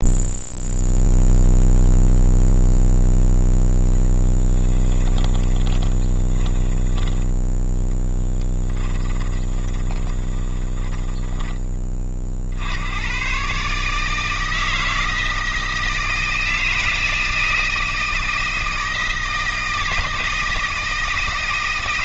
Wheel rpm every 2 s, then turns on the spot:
0, 0, 10, 10, 10, 10, 90, 160, 160, 160, 160.
4-12